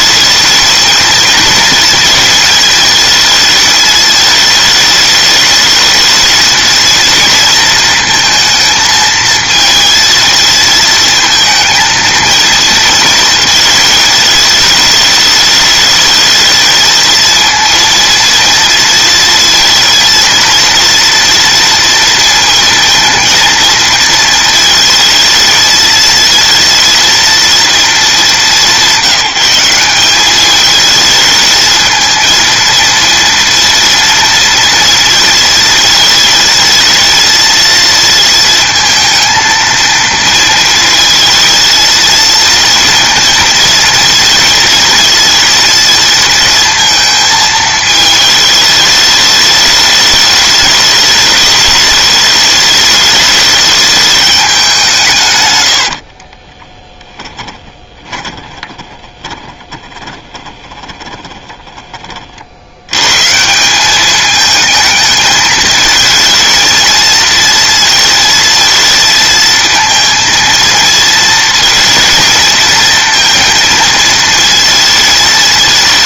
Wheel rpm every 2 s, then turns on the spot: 220, 220, 220, 220, 220, 230, 230, 220, 220, 230, 230, 230, 230, 230, 220, 200, 230, 230, 220, 220, 230, 230, 230, 230, 220, 210, 210, 210, 60, 20, 20, 30, 200, 220, 230, 230, 230, 230.
56-62